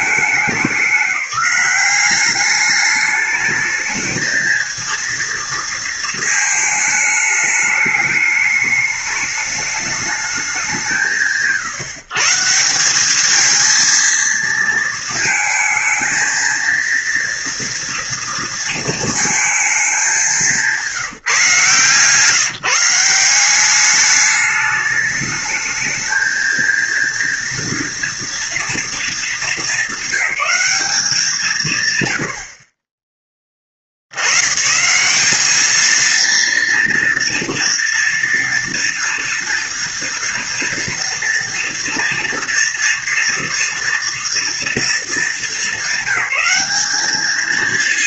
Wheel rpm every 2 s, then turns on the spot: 200, 200, 230, 220, 210, 190, 180, 230, 230, 230, 170, 160, 210, 220, 230, 200, 50, 130, 230, 230, 240, 230, 230, 200.
none